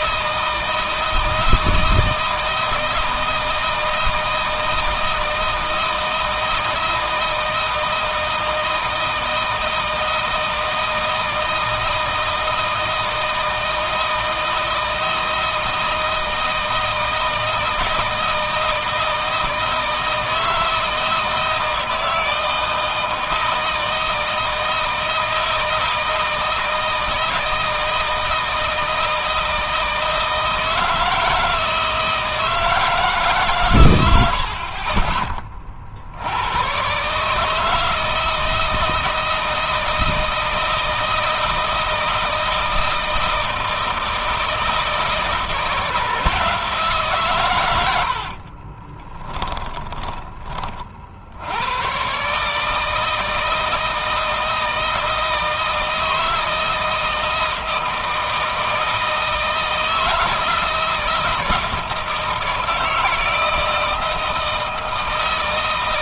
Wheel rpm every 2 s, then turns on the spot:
160, 160, 160, 160, 160, 160, 160, 160, 170, 160, 160, 160, 160, 160, 160, 160, 160, 70, 100, 160, 160, 160, 160, 150, 50, 30, 150, 160, 160, 160, 160, 160, 160.
48-50